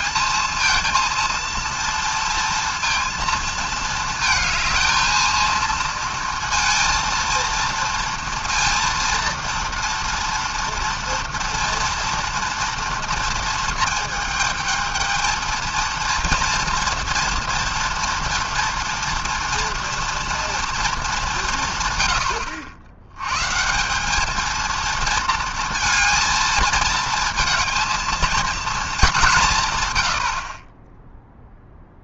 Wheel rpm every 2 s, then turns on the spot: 230, 230, 220, 230, 230, 240, 230, 220, 240, 230, 230, 80, 230, 230, 220, 30.
none